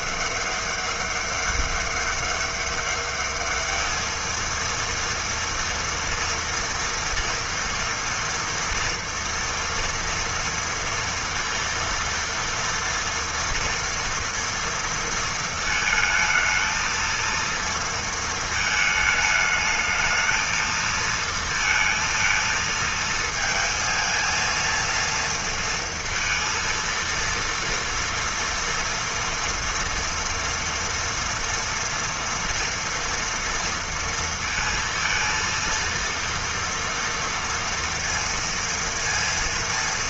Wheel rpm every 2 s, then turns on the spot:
200, 200, 230, 230, 230, 230, 230, 230, 220, 220, 220, 230, 230, 230, 230, 230, 230, 230, 230, 230.
none